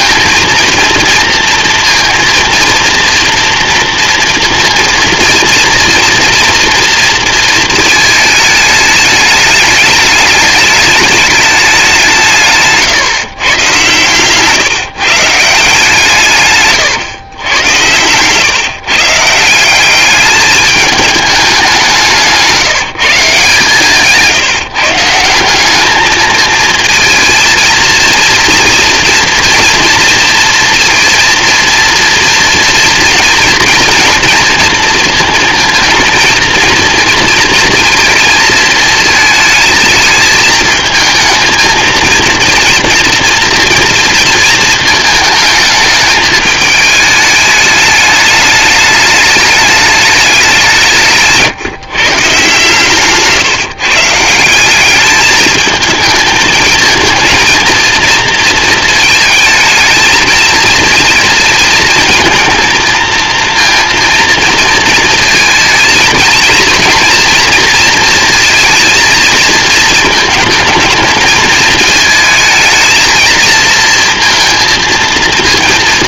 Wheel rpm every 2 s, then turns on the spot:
230, 230, 230, 230, 210, 210, 150, 150, 120, 140, 210, 170, 150, 220, 230, 240, 230, 230, 230, 220, 220, 230, 220, 210, 210, 180, 140, 190, 220, 220, 230, 230, 230, 230, 230, 220, 220, 230.
12-14